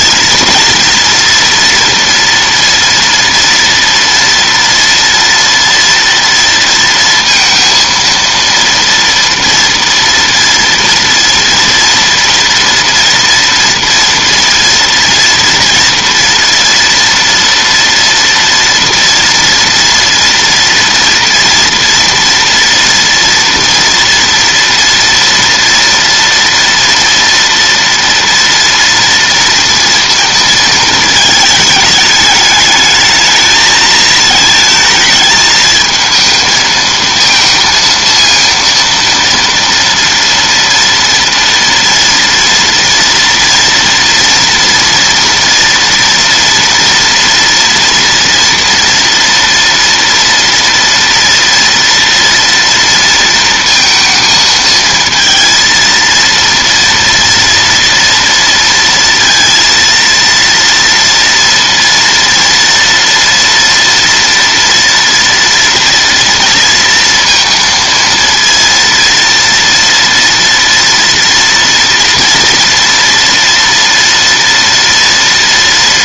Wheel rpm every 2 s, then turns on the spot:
230, 230, 230, 230, 230, 230, 240, 230, 230, 230, 230, 230, 230, 230, 230, 230, 210, 220, 220, 230, 230, 230, 240, 230, 230, 230, 230, 230, 230, 230, 230, 230, 230, 230, 230, 230, 230, 230.
none